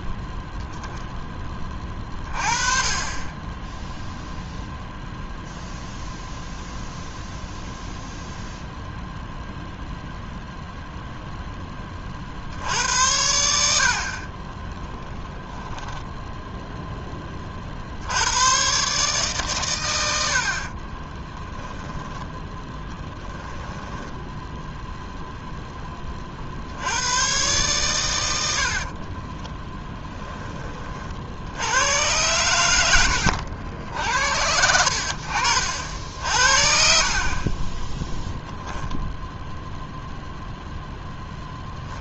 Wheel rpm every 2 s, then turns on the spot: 0, 30, 0, 0, 0, 0, 80, 30, 0, 130, 50, 10, 0, 80, 60, 20, 100, 80, 50, 0, 0.
14-16 20-24 28-30